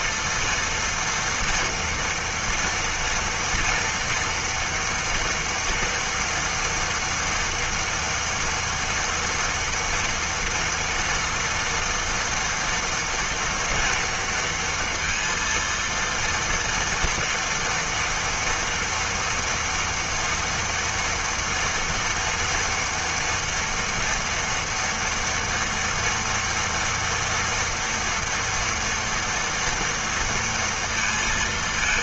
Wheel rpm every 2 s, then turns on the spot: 230, 230, 230, 230, 230, 230, 230, 230, 230, 230, 230, 230, 230, 240, 230, 230.
none